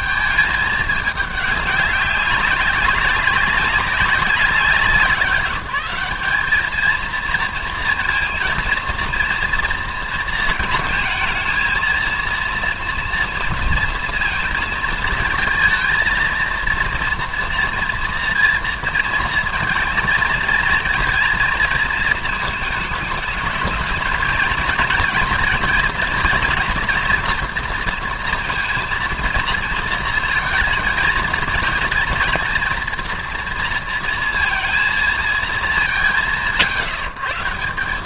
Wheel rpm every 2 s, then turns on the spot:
210, 190, 180, 210, 230, 220, 230, 230, 230, 240, 230, 220, 220, 230, 230, 230, 230, 230, 150.
none